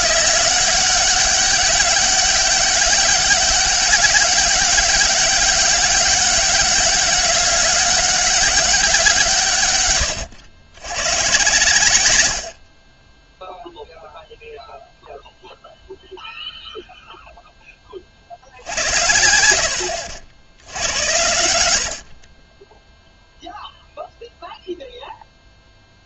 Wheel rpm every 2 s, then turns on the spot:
200, 190, 200, 200, 190, 100, 30, 0, 0, 70, 80, 0, 0.
none